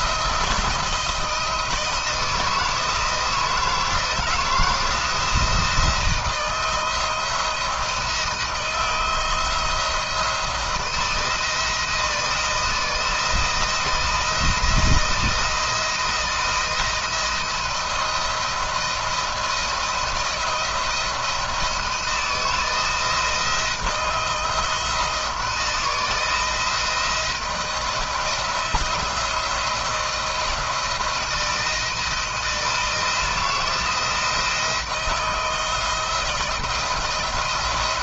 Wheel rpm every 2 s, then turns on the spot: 170, 160, 160, 160, 160, 160, 160, 170, 170, 170, 170, 160, 160, 160, 170, 170, 170, 170, 170.
none